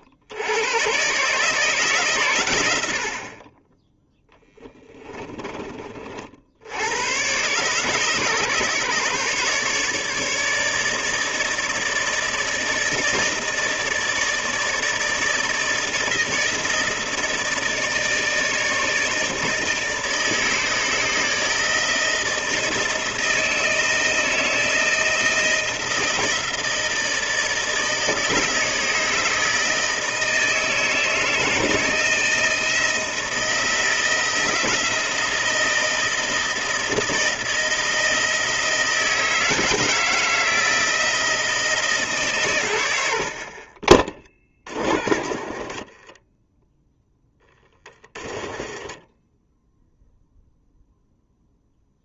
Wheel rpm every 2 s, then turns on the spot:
130, 80, 20, 90, 140, 150, 160, 160, 160, 150, 150, 160, 160, 160, 150, 160, 160, 160, 160, 160, 160, 90, 40, 0, 20, 0.
4-6 48-50